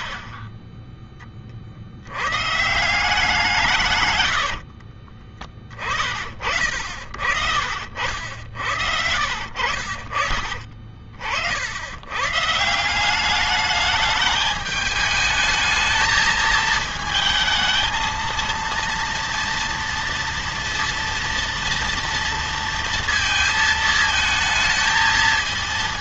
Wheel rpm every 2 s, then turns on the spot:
40, 110, 90, 30, 70, 60, 110, 210, 220, 230, 230, 230, 220.
4-6 10-12